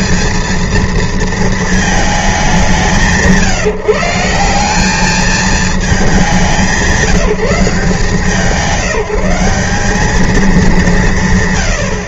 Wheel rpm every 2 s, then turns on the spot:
230, 180, 190, 180, 180, 210.
none